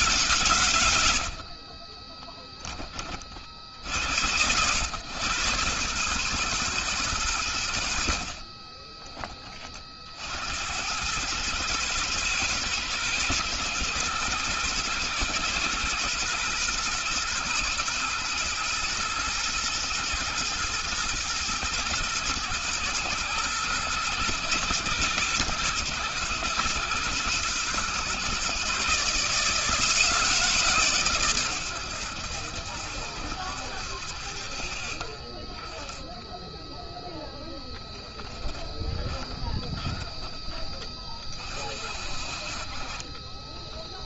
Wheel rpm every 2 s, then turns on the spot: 70, 50, 110, 110, 30, 90, 120, 120, 120, 120, 110, 110, 120, 110, 140, 130, 70, 20, 0, 20, 40, 20.
38-40 42-44